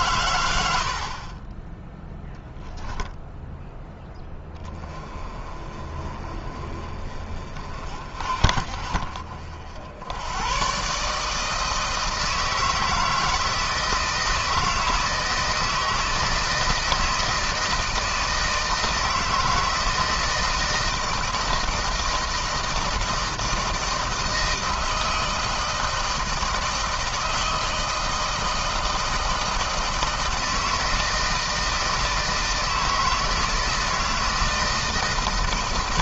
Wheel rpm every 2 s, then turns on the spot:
70, 0, 20, 40, 50, 140, 160, 160, 160, 160, 160, 160, 160, 160, 160, 160, 160, 160.
none